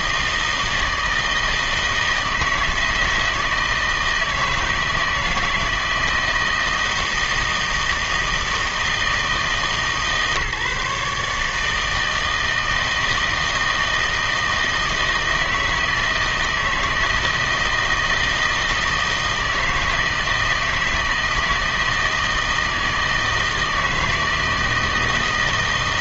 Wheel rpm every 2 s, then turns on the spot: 160, 160, 160, 160, 160, 150, 160, 160, 160, 160, 160, 160, 160.
none